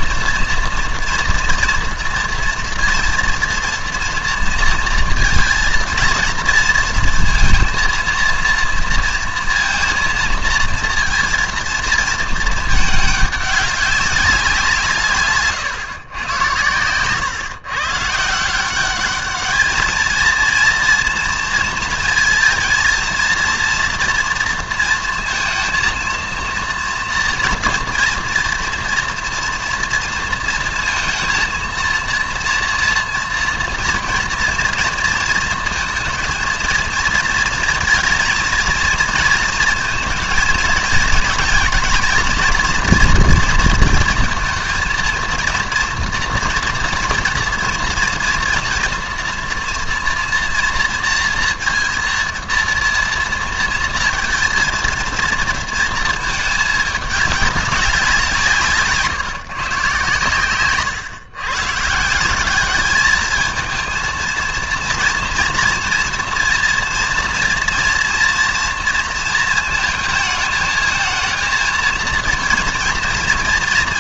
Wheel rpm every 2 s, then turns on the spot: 230, 240, 230, 230, 230, 230, 220, 180, 110, 180, 230, 230, 230, 230, 230, 230, 230, 230, 230, 230, 230, 240, 220, 230, 230, 230, 230, 230, 210, 160, 120, 200, 230, 230, 230, 220, 230.
none